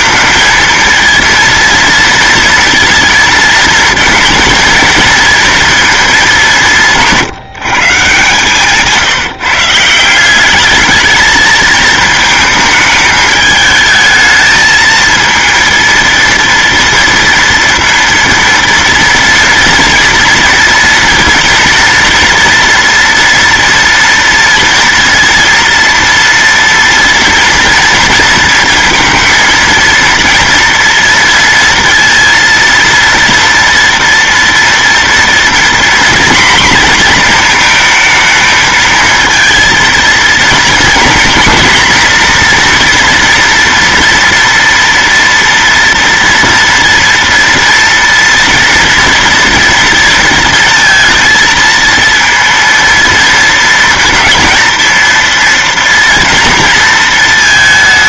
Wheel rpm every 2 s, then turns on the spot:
230, 230, 230, 190, 150, 210, 220, 220, 230, 230, 230, 230, 240, 230, 230, 230, 230, 230, 240, 220, 240, 240, 230, 230, 230, 230, 230, 230, 230.
6-8